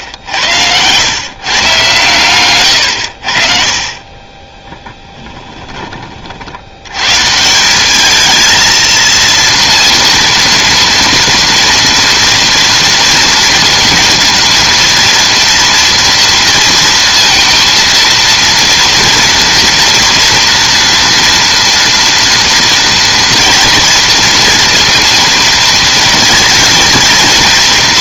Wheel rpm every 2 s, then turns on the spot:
100, 100, 10, 70, 220, 230, 230, 230, 230, 230, 240, 230, 230, 230.
2-6